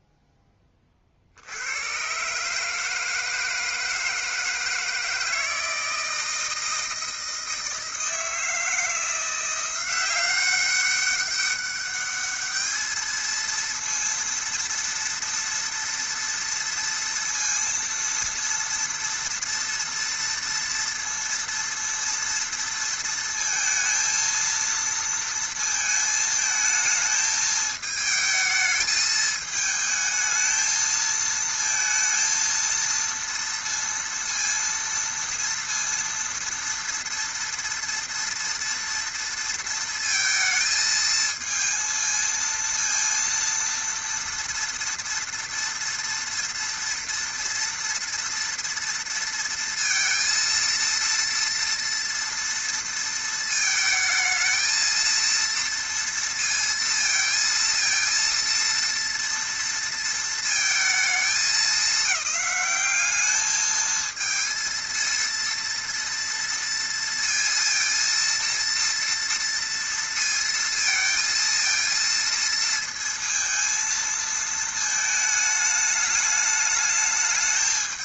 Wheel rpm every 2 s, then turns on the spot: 10, 150, 160, 160, 160, 190, 210, 230, 230, 230, 230, 230, 230, 220, 220, 220, 230, 230, 230, 230, 220, 230, 230, 230, 230, 230, 230, 220, 230, 230, 230, 200, 230, 230, 230, 230, 230, 220, 210.
none